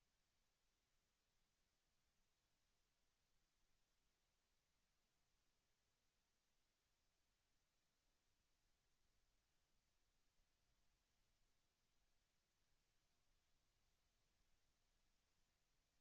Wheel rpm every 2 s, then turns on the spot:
0, 0, 0, 0, 0, 0, 0, 0.
none